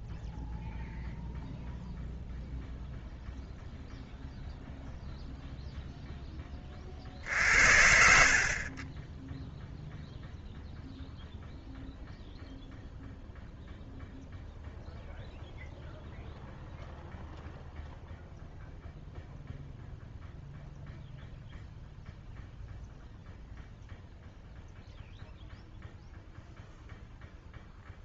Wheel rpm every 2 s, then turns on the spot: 0, 0, 0, 40, 30, 0, 0, 0, 0, 0, 0, 0, 0, 0.
none